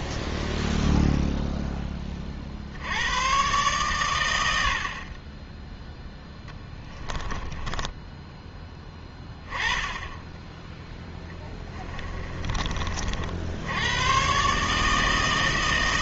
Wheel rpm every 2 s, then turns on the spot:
20, 70, 60, 10, 10, 10, 30, 150.
0-2 6-8